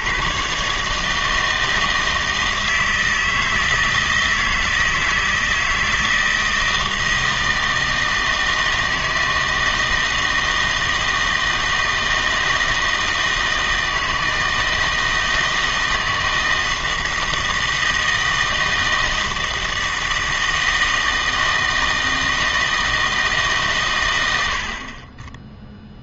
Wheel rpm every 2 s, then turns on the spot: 140, 160, 160, 160, 160, 160, 160, 160, 160, 160, 160, 160, 70.
none